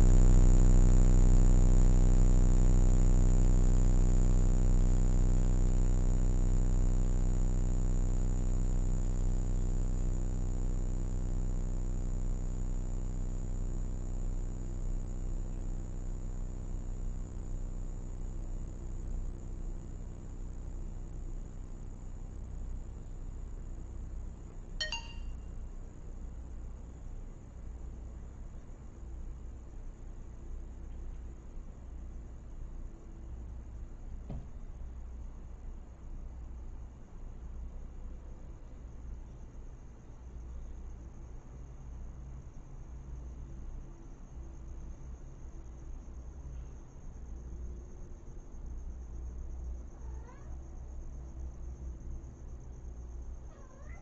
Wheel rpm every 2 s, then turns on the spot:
0, 0, 0, 0, 0, 0, 0, 0, 0, 0, 0, 0, 0, 0, 0, 0, 0, 0, 0, 0, 0, 0, 0, 0, 0, 0, 0.
none